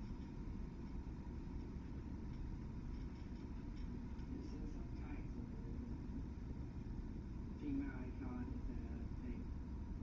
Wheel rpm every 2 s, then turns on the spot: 0, 0, 0, 0, 0.
none